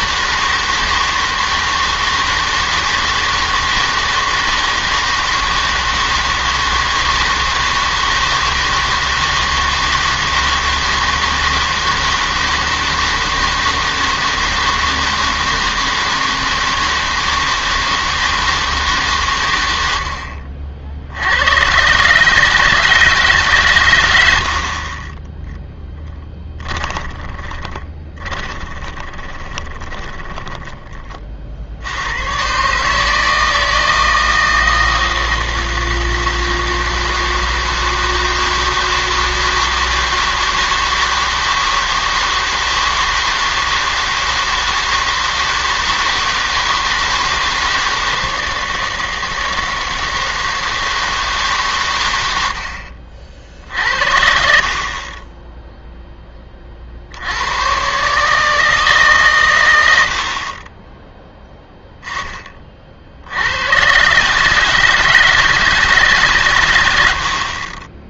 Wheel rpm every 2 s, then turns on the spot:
160, 160, 160, 160, 160, 160, 160, 160, 160, 160, 70, 150, 70, 10, 20, 10, 130, 160, 160, 160, 160, 160, 160, 160, 160, 160, 70, 60, 30, 150, 40, 30, 150, 120.
26-30